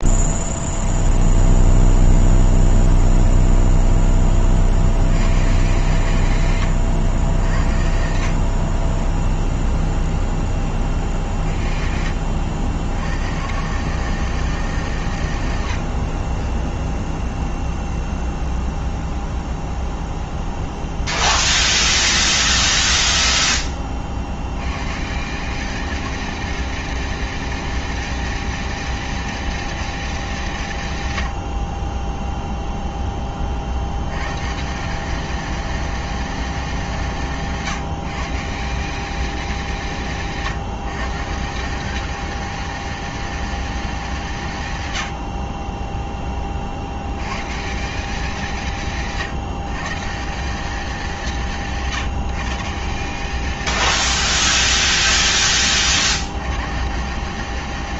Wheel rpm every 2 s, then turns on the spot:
0, 0, 30, 100, 40, 10, 60, 150, 20, 0, 0, 0, 90, 210, 230, 190, 0, 140, 200, 150, 160, 210, 140, 30, 180, 180, 150, 210, 150.
none